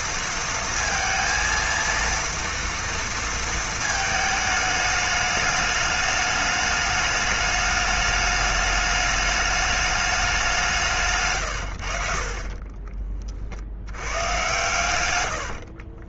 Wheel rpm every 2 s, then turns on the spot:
230, 230, 220, 210, 210, 180, 40, 120.
12-14